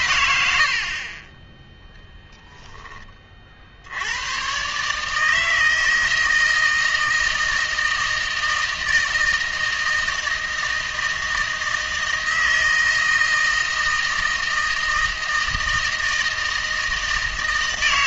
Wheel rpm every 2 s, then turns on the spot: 70, 20, 140, 160, 160, 160, 160, 160, 160.
none